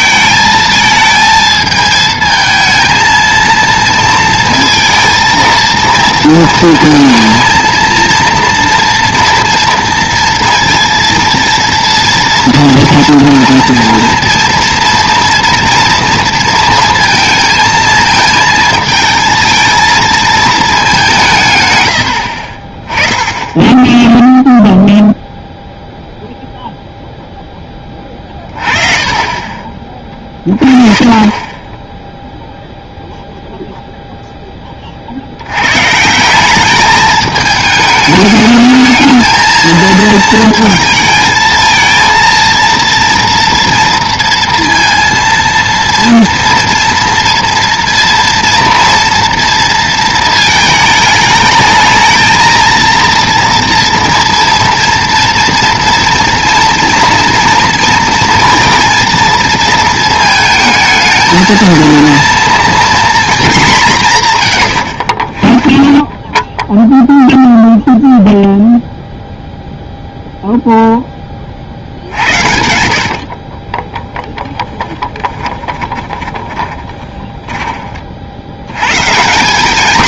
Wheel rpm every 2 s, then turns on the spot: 220, 230, 230, 230, 230, 230, 230, 230, 230, 220, 210, 40, 0, 0, 30, 30, 0, 20, 200, 220, 220, 230, 230, 230, 230, 220, 230, 230, 230, 230, 220, 240, 120, 0, 0, 0, 70, 10, 30, 70.
28-30 72-78